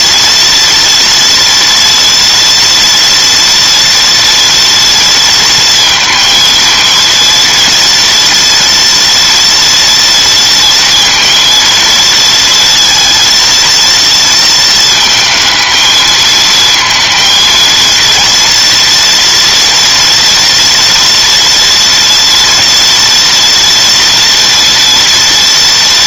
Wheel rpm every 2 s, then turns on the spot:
230, 230, 230, 230, 240, 230, 230, 230, 230, 230, 230, 240, 230.
none